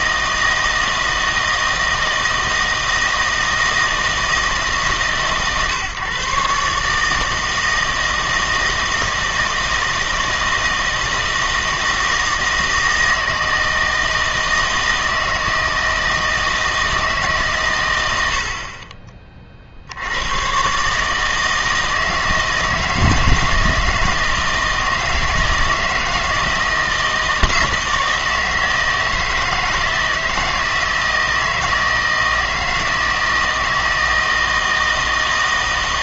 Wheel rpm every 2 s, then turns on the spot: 160, 160, 150, 150, 160, 160, 160, 160, 160, 40, 140, 160, 160, 160, 160, 160, 160, 160.
none